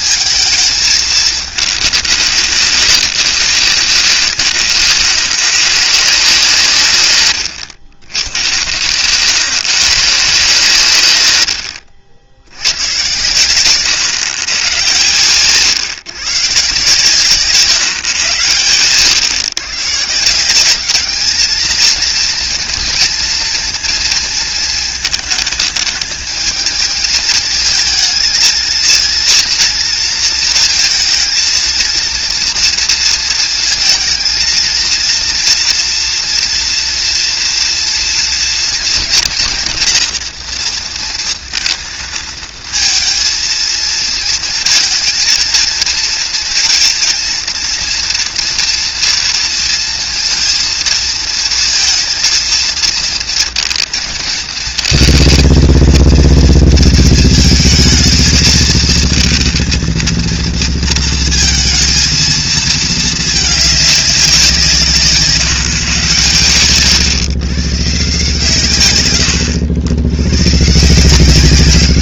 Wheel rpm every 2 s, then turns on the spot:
220, 190, 150, 130, 130, 130, 90, 110, 140, 110, 200, 230, 220, 220, 220, 230, 230, 230, 230, 230, 230, 220, 230, 230, 240, 230, 220, 230, 230, 220, 230, 220, 160, 120, 140, 140.
none